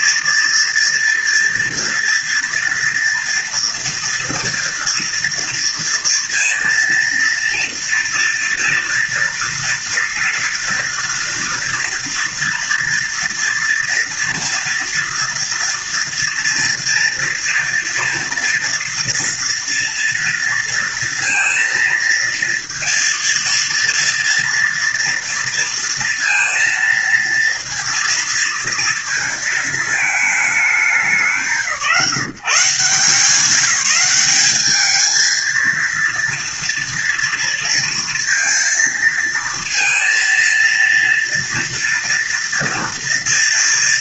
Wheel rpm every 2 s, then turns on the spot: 230, 230, 230, 230, 230, 230, 230, 230, 230, 230, 230, 230, 230, 230, 230, 190, 160, 210, 230, 230, 230, 230.
none